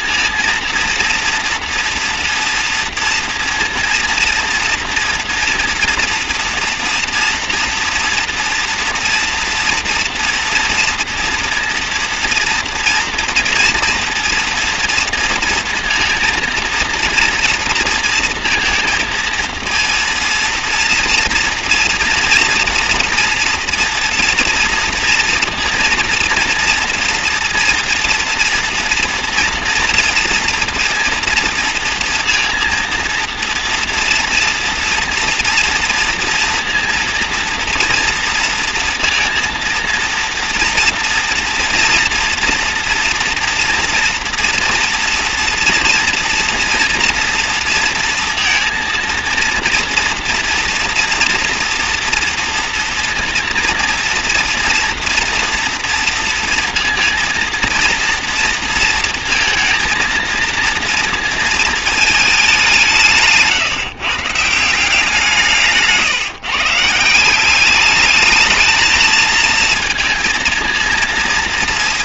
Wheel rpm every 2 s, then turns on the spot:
230, 230, 230, 230, 230, 230, 230, 230, 230, 230, 230, 240, 240, 230, 230, 230, 230, 230, 230, 230, 240, 230, 230, 230, 230, 230, 230, 230, 230, 230, 230, 180, 170, 150, 220, 230.
none